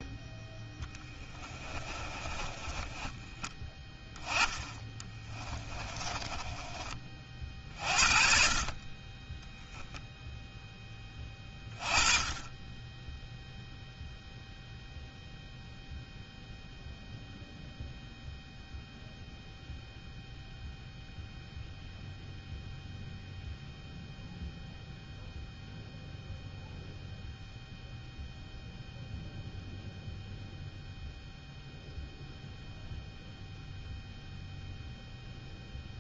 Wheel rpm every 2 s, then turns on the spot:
0, 20, 10, 10, 40, 0, 20, 0, 0, 0, 0, 0, 0, 0, 0, 0, 0, 0.
2-4 6-8